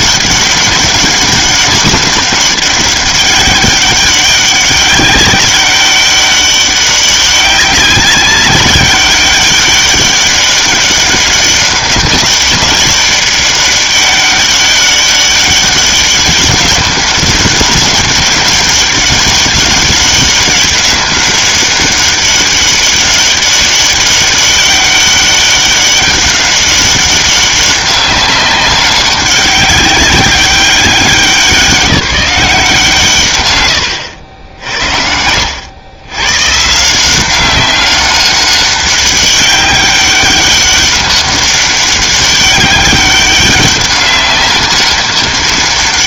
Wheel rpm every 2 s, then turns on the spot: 200, 200, 200, 200, 190, 200, 200, 200, 200, 200, 200, 200, 200, 200, 200, 190, 170, 70, 150, 200, 200, 200, 200.
none